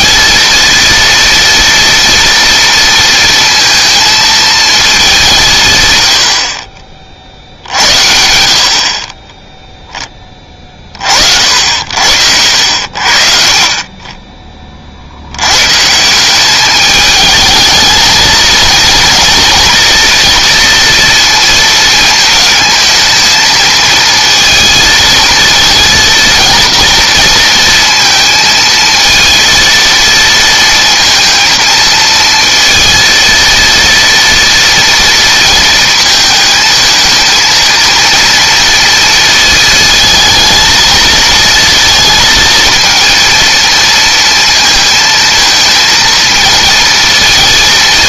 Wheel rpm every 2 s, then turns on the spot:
230, 230, 220, 40, 50, 30, 70, 30, 200, 220, 230, 220, 220, 230, 220, 230, 230, 230, 220, 230, 220, 220, 230, 220.
none